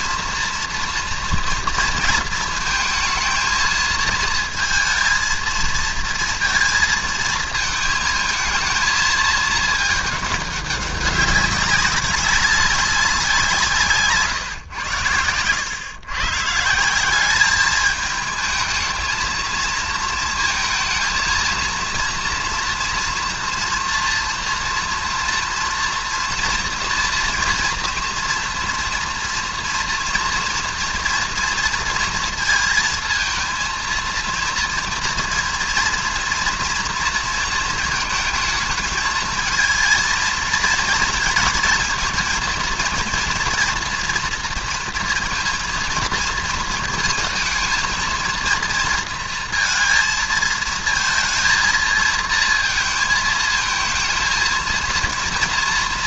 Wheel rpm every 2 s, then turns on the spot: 230, 220, 230, 230, 230, 200, 200, 130, 150, 220, 230, 240, 230, 230, 230, 230, 230, 230, 230, 220, 220, 220, 230, 220, 230, 230, 230, 230.
none